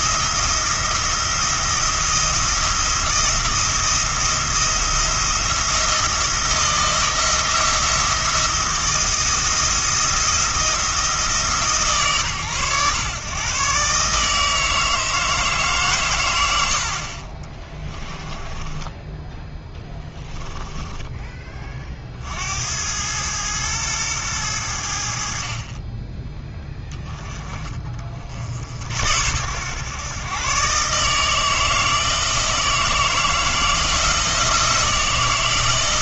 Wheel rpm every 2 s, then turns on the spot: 170, 170, 170, 170, 170, 170, 120, 160, 70, 10, 10, 80, 80, 20, 70, 130, 160, 170.
18-22